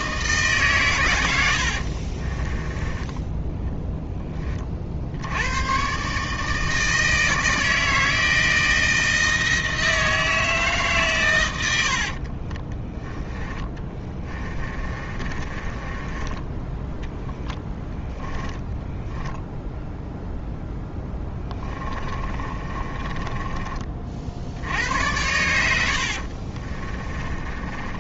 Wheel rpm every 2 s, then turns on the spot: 120, 20, 50, 160, 160, 140, 20, 30, 10, 0, 10, 30, 80, 30.
2-4 12-16 20-24 26-28